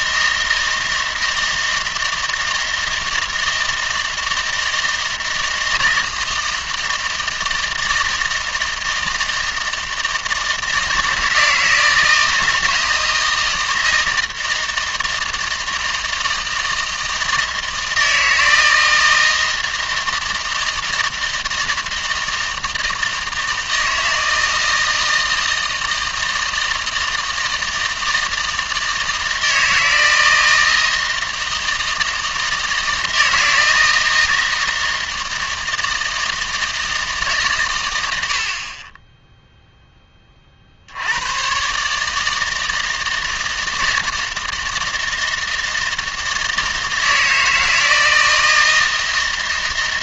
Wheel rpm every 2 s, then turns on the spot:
160, 160, 160, 160, 160, 160, 160, 160, 160, 160, 160, 160, 160, 160, 160, 160, 160, 160, 160, 30, 60, 160, 160, 160, 160.
none